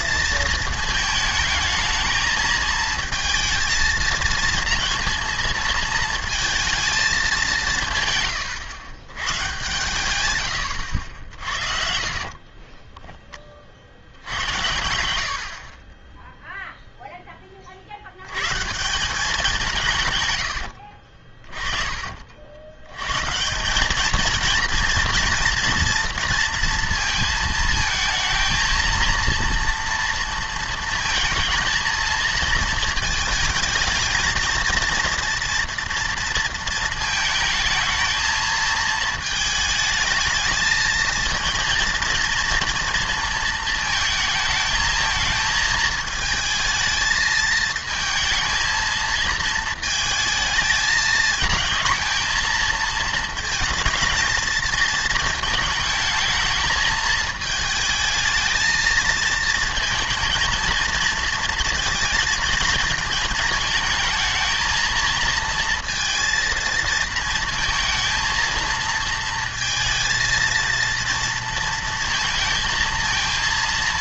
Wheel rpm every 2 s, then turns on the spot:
220, 220, 230, 230, 120, 120, 30, 90, 0, 160, 90, 90, 230, 230, 230, 230, 220, 230, 230, 220, 220, 230, 220, 220, 220, 220, 230, 230, 220, 220, 230, 220, 230, 230, 230, 230, 220.
12-14 20-22